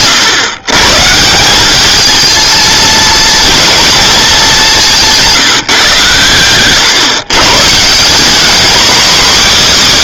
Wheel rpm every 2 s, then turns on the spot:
120, 220, 190, 120, 240.
none